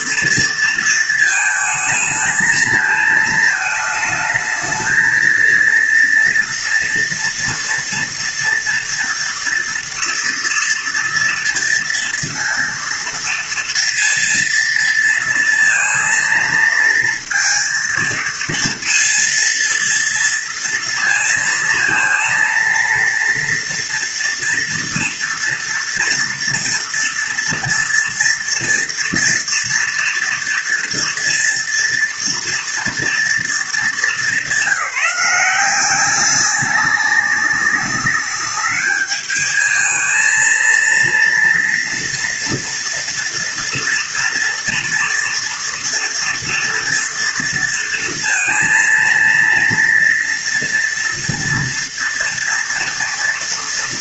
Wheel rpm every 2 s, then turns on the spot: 220, 220, 230, 230, 230, 230, 230, 230, 230, 230, 230, 230, 230, 230, 230, 230, 220, 180, 200, 210, 230, 230, 230, 230, 230, 230, 230.
none